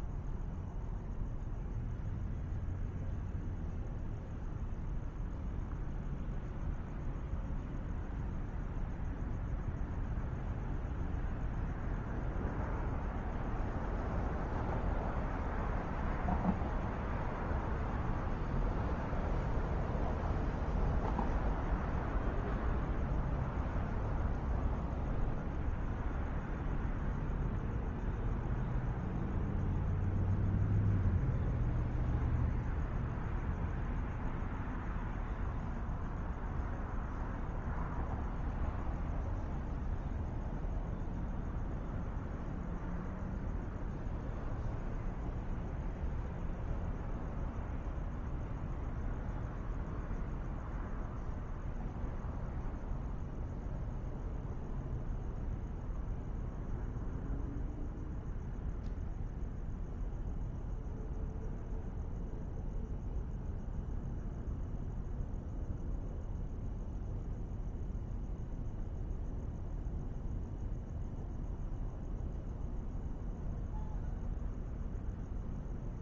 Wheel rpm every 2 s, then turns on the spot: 0, 0, 0, 0, 0, 0, 0, 0, 0, 0, 0, 0, 0, 0, 0, 0, 0, 0, 0, 0, 0, 0, 0, 0, 0, 0, 0, 0, 0, 0, 0, 0, 0, 0, 0, 0, 0, 0.
none